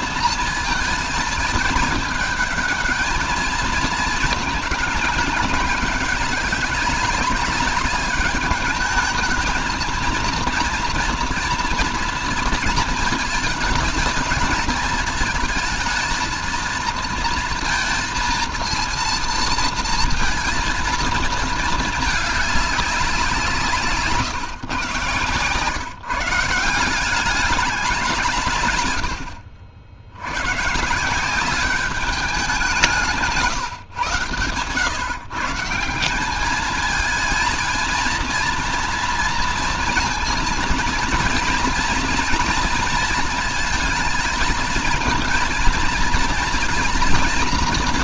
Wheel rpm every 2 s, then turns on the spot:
220, 220, 220, 200, 210, 230, 220, 220, 230, 230, 230, 200, 120, 170, 120, 140, 180, 130, 220, 230, 230, 230, 220, 230.
none